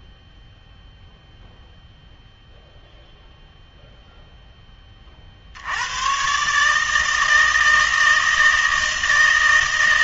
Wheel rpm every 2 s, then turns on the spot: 0, 0, 20, 150, 160.
none